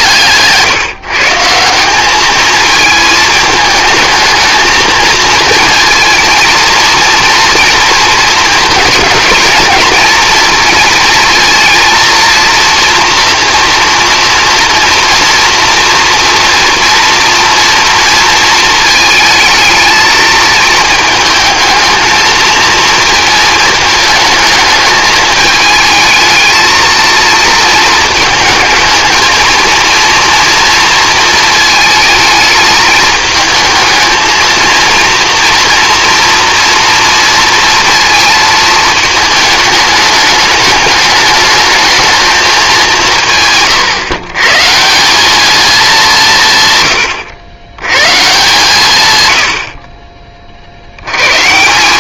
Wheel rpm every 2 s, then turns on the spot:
150, 220, 230, 230, 230, 230, 230, 230, 230, 220, 220, 220, 210, 220, 220, 230, 220, 230, 230, 220, 210, 200, 150, 130, 140, 40.
none